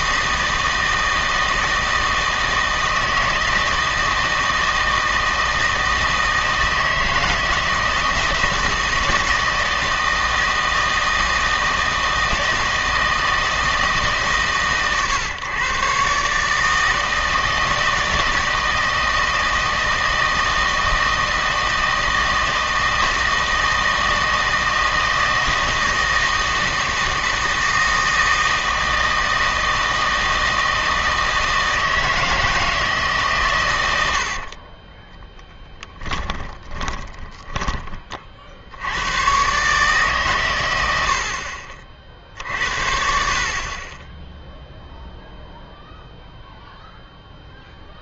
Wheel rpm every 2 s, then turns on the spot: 160, 160, 160, 160, 160, 160, 160, 130, 160, 160, 160, 160, 160, 160, 160, 160, 160, 20, 10, 80, 100, 60, 0, 0.
34-38